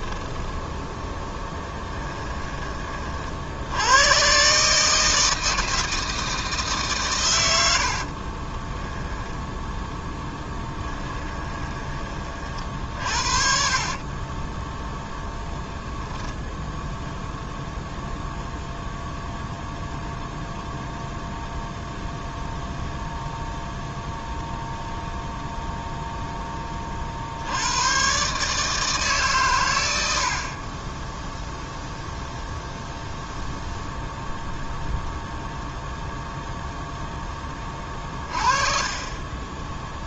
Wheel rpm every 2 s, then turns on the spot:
10, 20, 140, 150, 10, 10, 40, 20, 10, 0, 0, 0, 0, 20, 150, 30, 0, 0, 0, 30.
8-12 14-18